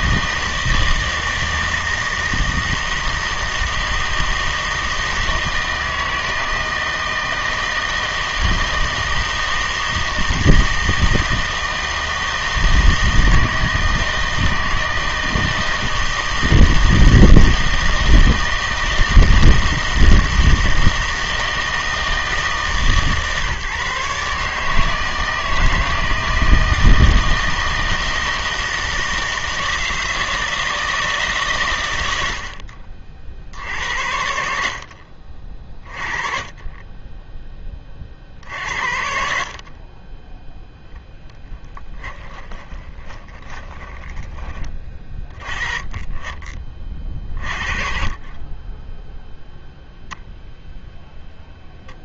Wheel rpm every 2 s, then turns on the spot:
160, 160, 160, 160, 160, 160, 160, 160, 160, 160, 160, 150, 150, 160, 160, 160, 50, 60, 20, 60, 0, 20, 40, 50, 20, 0.
42-44